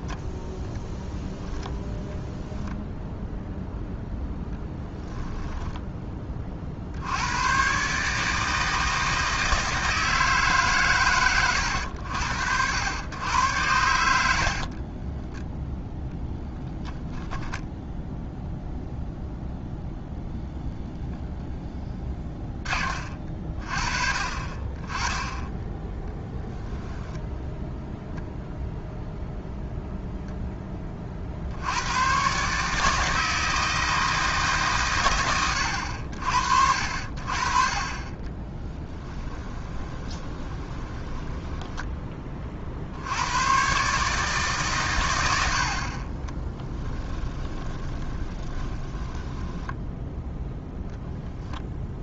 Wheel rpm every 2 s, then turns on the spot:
10, 0, 10, 70, 160, 130, 90, 30, 10, 0, 0, 30, 20, 10, 0, 30, 160, 120, 60, 10, 20, 70, 110, 20, 20, 0.
0-2 14-18 38-42 46-50